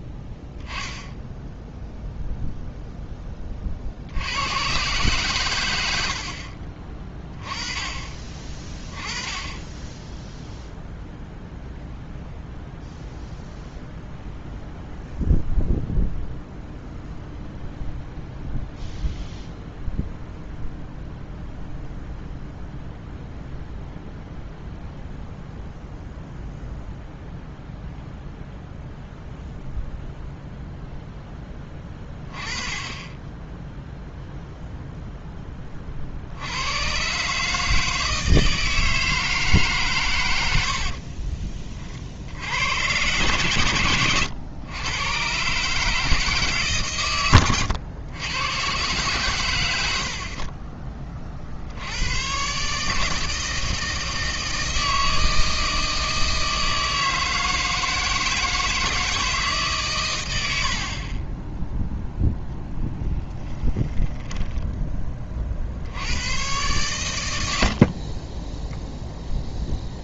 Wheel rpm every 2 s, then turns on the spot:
10, 0, 100, 40, 30, 0, 0, 0, 0, 0, 0, 0, 0, 0, 0, 0, 20, 0, 90, 160, 90, 90, 110, 140, 120, 40, 120, 160, 160, 160, 80, 10, 10, 120, 20.
40-42 62-66 68-70